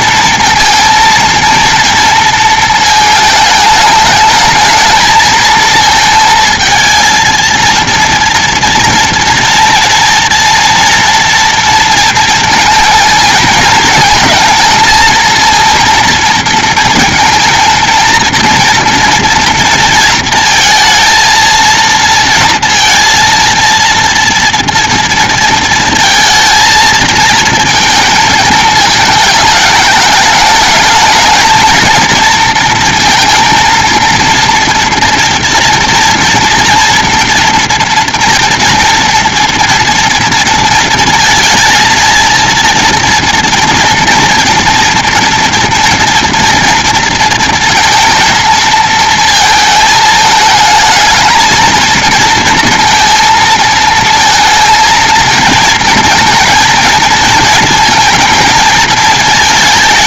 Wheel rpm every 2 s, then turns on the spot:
230, 230, 220, 230, 230, 230, 220, 220, 230, 230, 230, 230, 230, 230, 220, 220, 230, 230, 230, 230, 230, 230, 230, 230, 230, 220, 230, 230, 230, 220.
none